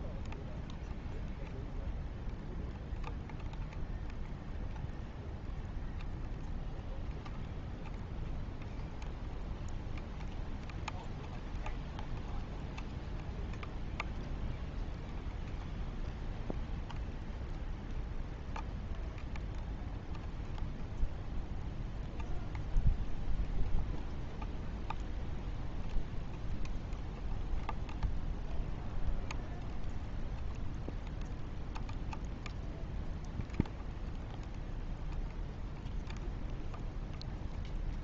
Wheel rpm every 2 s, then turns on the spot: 0, 0, 0, 0, 0, 0, 0, 0, 0, 0, 0, 0, 0, 0, 0, 0, 0, 0, 0.
none